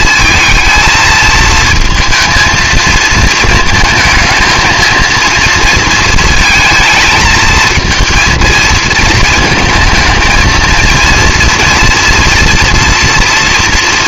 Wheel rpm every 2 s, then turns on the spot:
230, 230, 230, 220, 220, 220, 230.
none